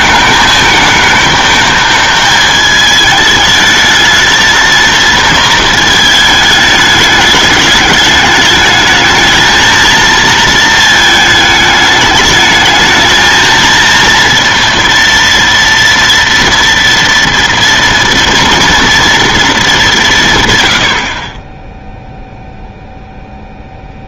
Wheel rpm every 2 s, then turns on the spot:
220, 220, 230, 220, 210, 230, 220, 230, 230, 230, 130, 0.
none